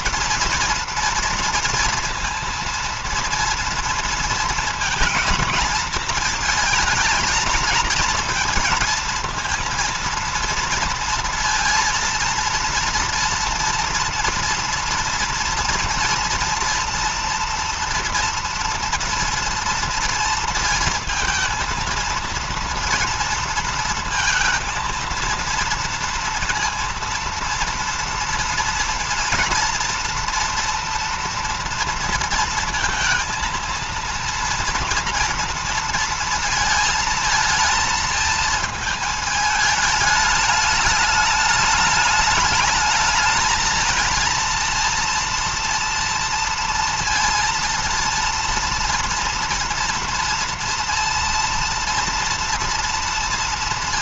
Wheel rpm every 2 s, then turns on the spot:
230, 230, 230, 220, 230, 230, 230, 230, 230, 230, 230, 230, 230, 230, 230, 230, 230, 230, 220, 220, 210, 210, 230, 230, 230, 230, 230.
none